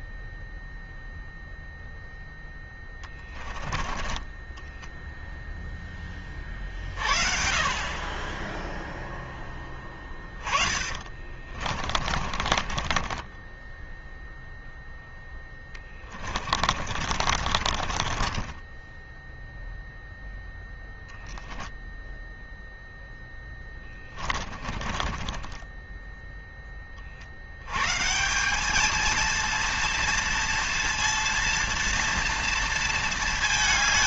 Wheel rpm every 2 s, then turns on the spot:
20, 0, 10, 20, 10, 20, 40, 0, 30, 20, 0, 0, 20, 10, 190, 230, 230.
4-6 10-14 16-20 24-26